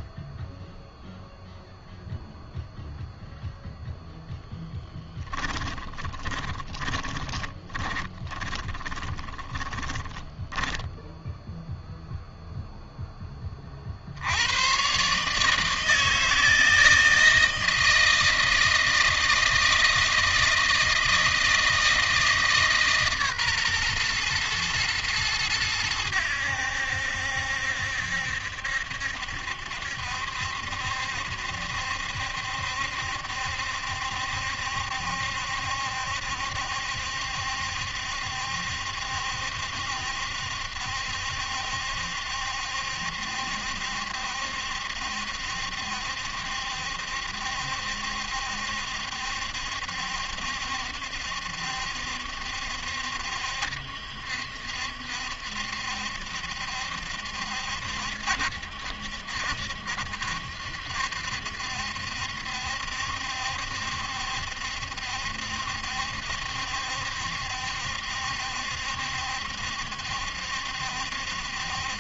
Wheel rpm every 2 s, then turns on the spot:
0, 0, 20, 30, 20, 10, 0, 90, 160, 160, 160, 150, 120, 90, 70, 70, 70, 70, 70, 70, 70, 70, 70, 70, 70, 70, 70, 70, 70, 70, 70, 70, 70, 70, 70, 70.
4-12